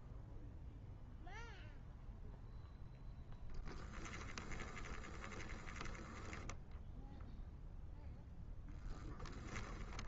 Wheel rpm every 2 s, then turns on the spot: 0, 0, 20, 10, 10.
4-8